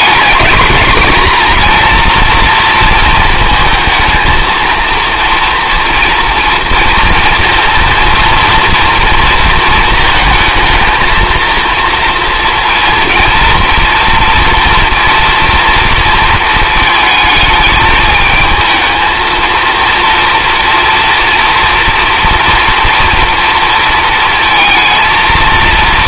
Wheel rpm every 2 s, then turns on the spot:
220, 230, 230, 230, 230, 230, 230, 230, 220, 220, 230, 230, 230.
none